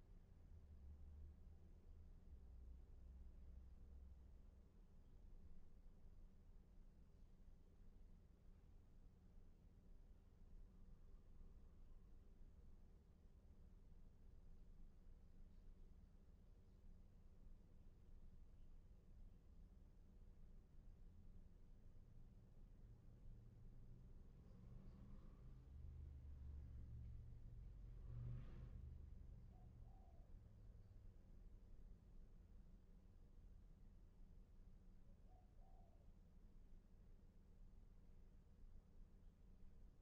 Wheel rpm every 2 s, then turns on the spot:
0, 0, 0, 0, 0, 0, 0, 0, 0, 0, 0, 0, 0, 0, 0, 0, 0, 0, 0, 0.
none